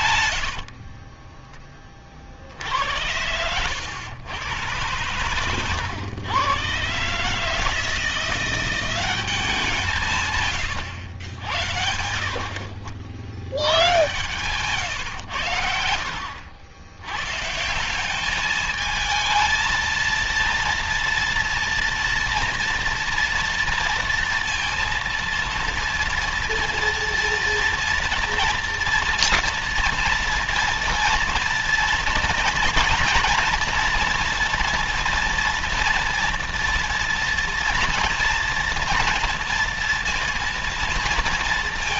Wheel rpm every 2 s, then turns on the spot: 50, 80, 110, 130, 180, 100, 70, 110, 100, 220, 230, 230, 230, 230, 240, 230, 230, 230, 230, 230, 230.
0-2